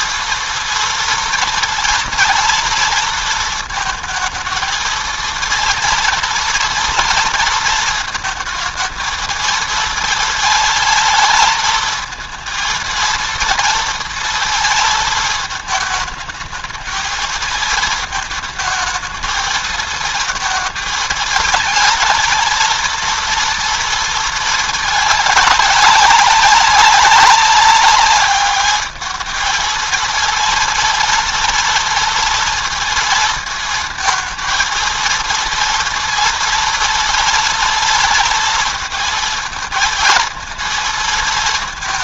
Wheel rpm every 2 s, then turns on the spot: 230, 230, 230, 230, 220, 220, 230, 220, 220, 220, 220, 230, 210, 190, 210, 230, 230, 230, 230, 230, 230.
none